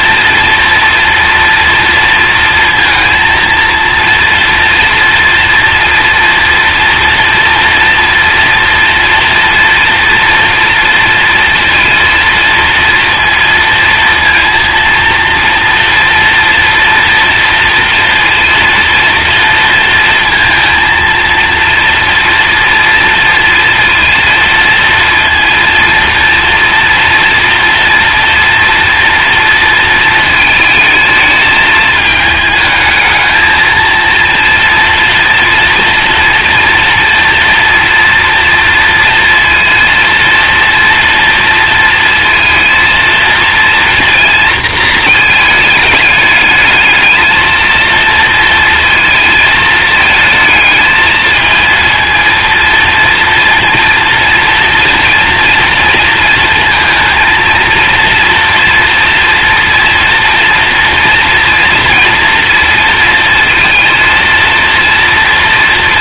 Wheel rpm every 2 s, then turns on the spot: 230, 230, 230, 240, 230, 230, 230, 230, 230, 230, 230, 230, 230, 230, 240, 220, 220, 230, 230, 230, 230, 230, 230, 220, 230, 220, 230, 230, 230, 230, 230, 230, 230.
none